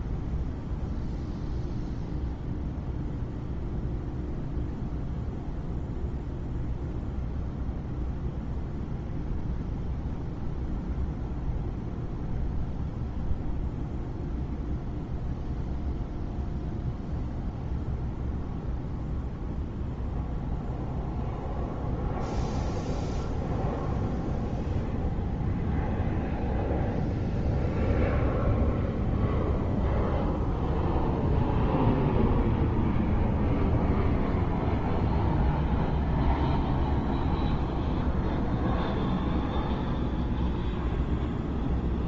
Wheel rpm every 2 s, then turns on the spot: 0, 0, 0, 0, 0, 0, 0, 0, 0, 0, 0, 0, 0, 0, 0, 0, 0, 0, 0, 0, 0.
none